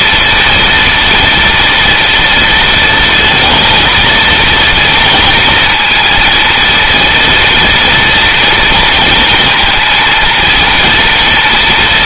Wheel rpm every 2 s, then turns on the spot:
240, 230, 230, 230, 230, 240.
none